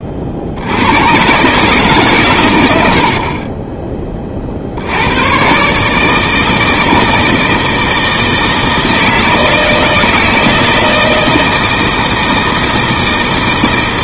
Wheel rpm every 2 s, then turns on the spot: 70, 110, 40, 160, 160, 160, 160.
none